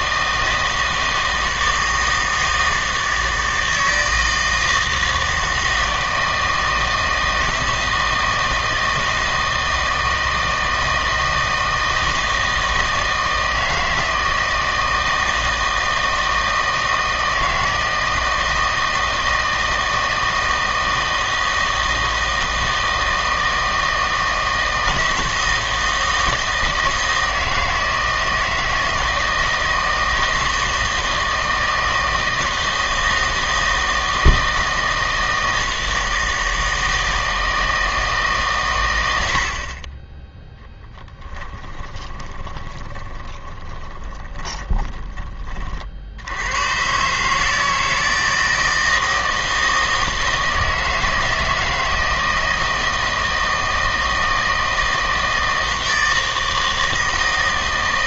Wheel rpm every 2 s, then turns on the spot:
160, 160, 160, 160, 160, 160, 160, 160, 160, 160, 160, 160, 160, 160, 160, 160, 160, 160, 160, 130, 0, 20, 20, 110, 160, 160, 160, 160, 160.
42-46